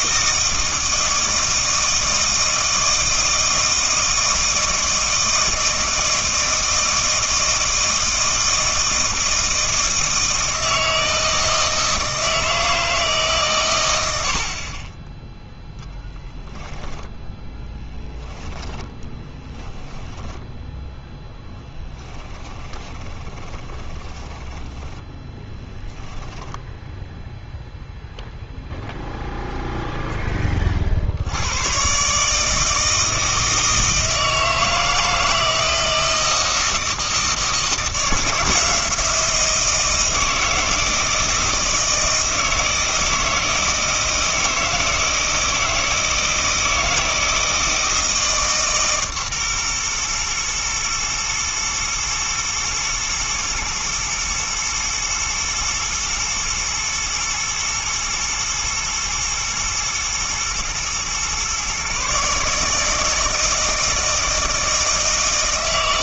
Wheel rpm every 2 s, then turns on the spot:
160, 160, 160, 160, 160, 160, 160, 30, 10, 10, 0, 20, 10, 0, 0, 30, 160, 160, 160, 160, 160, 160, 160, 160, 140, 120, 120, 110, 110, 110, 110, 150, 160.
18-20 22-26